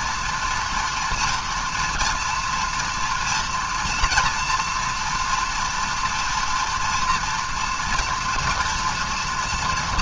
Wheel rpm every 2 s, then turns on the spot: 230, 240, 230, 230, 230.
none